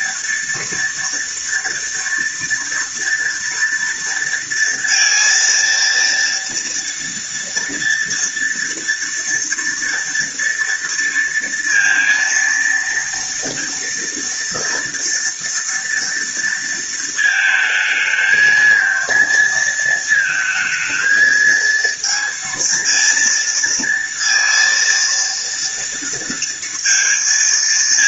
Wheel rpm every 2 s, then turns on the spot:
240, 230, 230, 230, 230, 230, 230, 230, 230, 220, 220, 230, 230, 230.
none